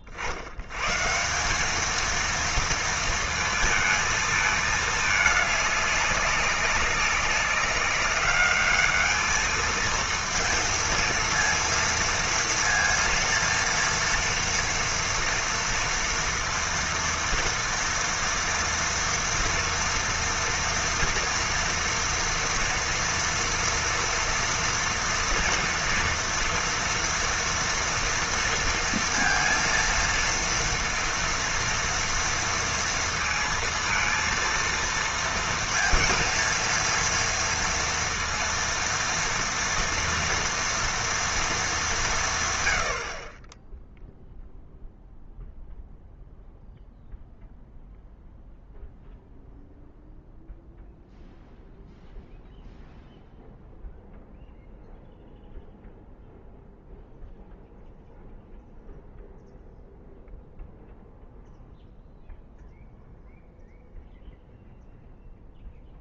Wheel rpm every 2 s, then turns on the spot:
50, 230, 220, 200, 200, 230, 230, 230, 230, 230, 230, 230, 230, 230, 230, 230, 230, 230, 230, 230, 230, 130, 0, 0, 0, 0, 0, 0, 0, 0, 0, 0, 0.
none